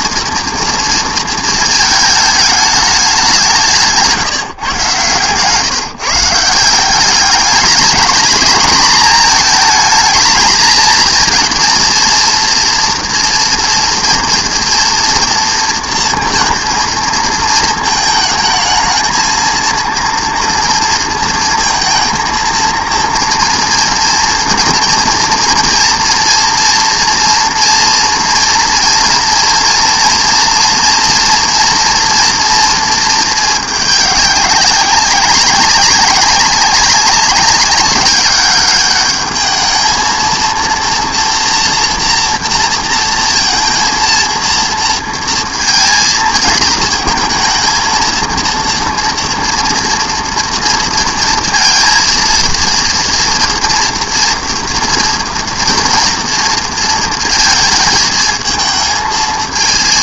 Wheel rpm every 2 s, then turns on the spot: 230, 210, 140, 180, 210, 220, 230, 230, 220, 220, 230, 230, 230, 230, 230, 230, 230, 190, 200, 210, 240, 230, 230, 220, 240, 230, 230, 230, 230, 220.
none